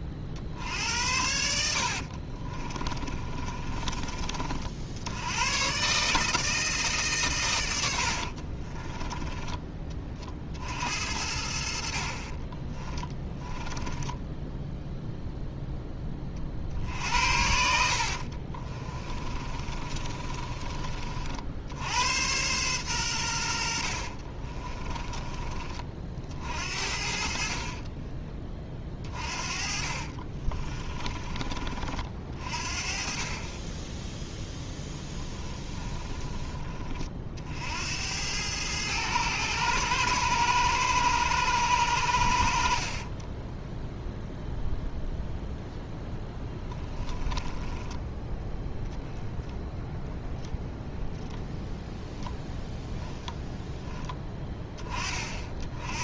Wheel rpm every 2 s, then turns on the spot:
40, 40, 50, 160, 40, 50, 20, 10, 40, 40, 30, 110, 30, 60, 20, 30, 40, 0, 20, 100, 110, 90, 0, 20, 10, 0, 0, 10.
2-4 8-10 12-16 18-22 24-26 30-32 46-48